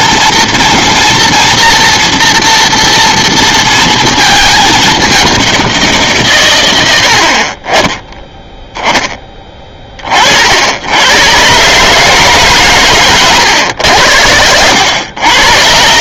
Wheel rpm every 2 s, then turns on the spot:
240, 230, 210, 120, 0, 60, 130, 90.
none